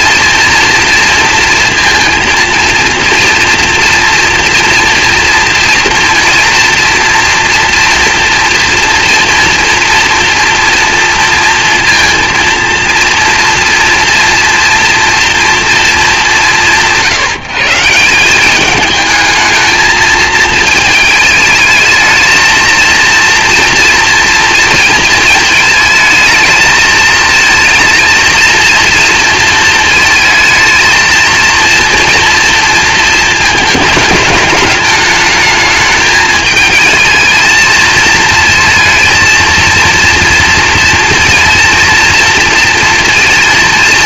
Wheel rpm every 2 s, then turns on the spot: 230, 230, 240, 230, 240, 230, 230, 230, 180, 200, 220, 230, 230, 220, 230, 220, 230, 220, 220, 230, 230, 230.
none